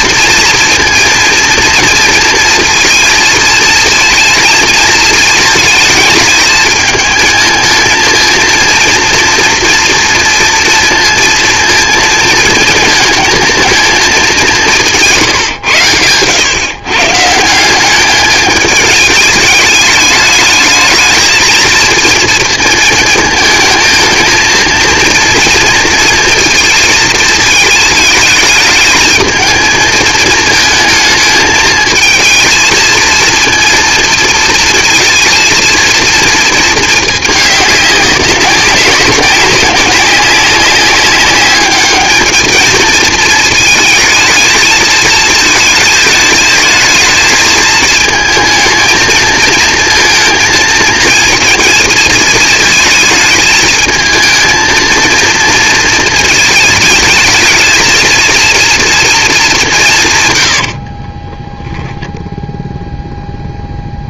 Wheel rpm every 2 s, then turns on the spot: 230, 230, 230, 220, 230, 230, 220, 190, 130, 210, 220, 220, 230, 230, 220, 220, 220, 230, 230, 200, 200, 220, 220, 220, 220, 220, 220, 230, 220, 230, 80, 0.
60-62